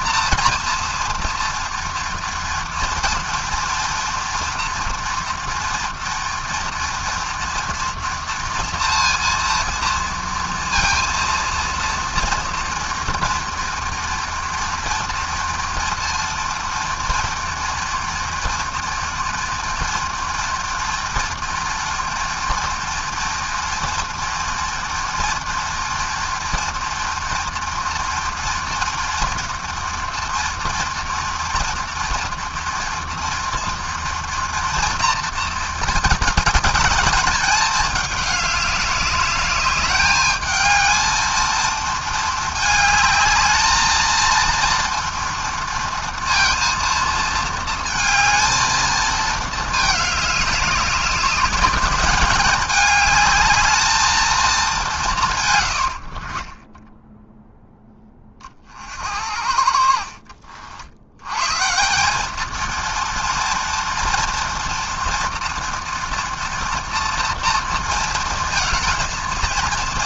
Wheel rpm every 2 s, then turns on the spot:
240, 230, 230, 230, 230, 230, 230, 230, 230, 230, 240, 240, 230, 230, 230, 230, 230, 230, 210, 200, 220, 220, 230, 230, 220, 200, 210, 210, 20, 50, 60, 220, 230, 230, 220.
56-58